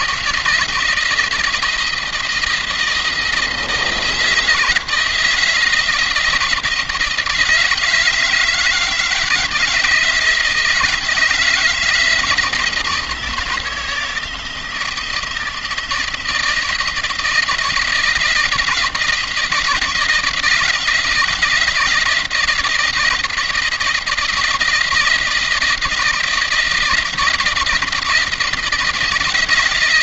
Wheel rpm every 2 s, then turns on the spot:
170, 160, 160, 160, 160, 160, 170, 160, 170, 170, 170, 170, 170, 170, 170.
none